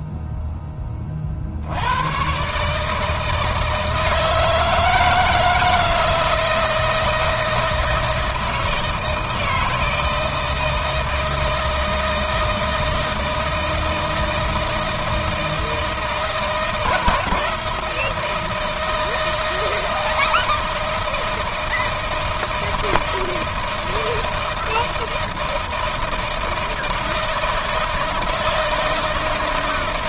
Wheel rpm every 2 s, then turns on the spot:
30, 150, 160, 160, 160, 160, 160, 160, 160, 160, 160, 160, 160, 160, 160.
none